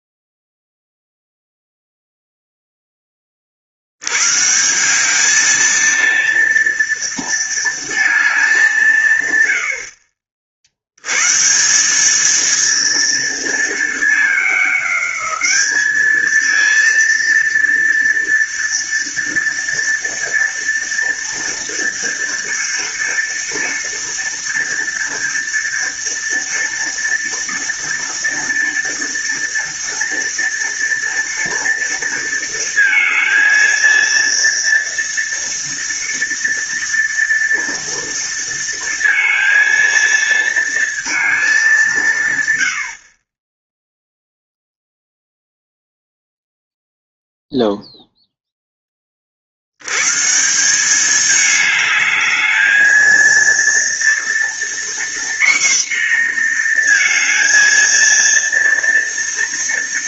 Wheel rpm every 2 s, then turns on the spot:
0, 10, 170, 230, 180, 80, 230, 200, 230, 230, 230, 230, 230, 230, 230, 230, 230, 230, 230, 230, 230, 100, 0, 0, 10, 190, 220, 240, 230, 230.
none